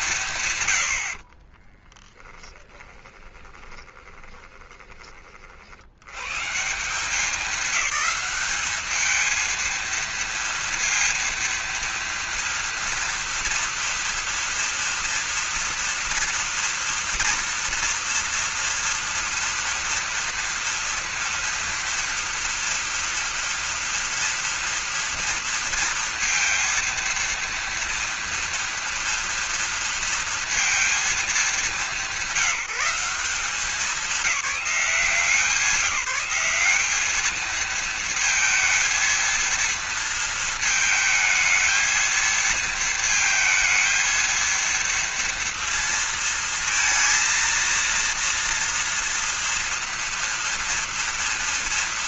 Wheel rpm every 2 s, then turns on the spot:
110, 20, 20, 170, 210, 230, 230, 240, 230, 230, 230, 230, 230, 230, 240, 230, 190, 200, 200, 230, 220, 220, 230, 230, 230, 230.
2-6